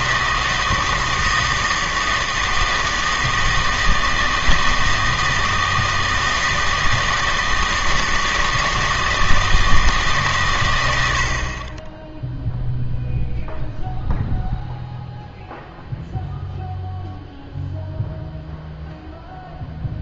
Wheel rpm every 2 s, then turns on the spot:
160, 160, 160, 160, 160, 110, 0, 0, 0, 0.
none